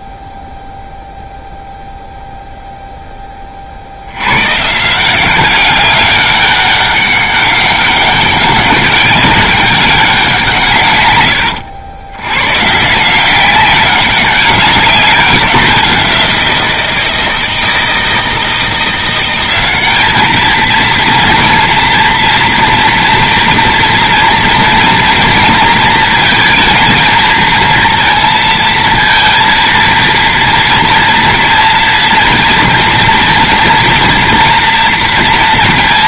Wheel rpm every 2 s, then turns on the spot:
0, 0, 140, 200, 190, 150, 130, 190, 170, 170, 220, 230, 230, 230, 230, 230, 230, 230.
none